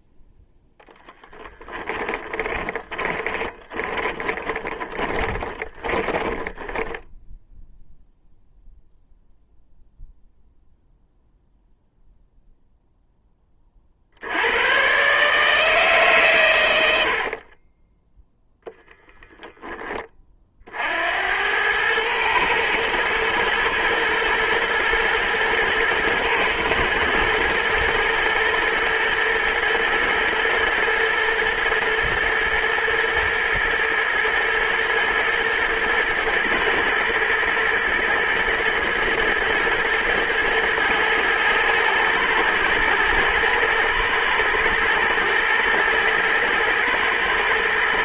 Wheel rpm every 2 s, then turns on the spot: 0, 20, 30, 20, 0, 0, 0, 90, 120, 20, 50, 110, 110, 110, 110, 110, 120, 110, 120, 110, 110, 110, 120, 120.
2-8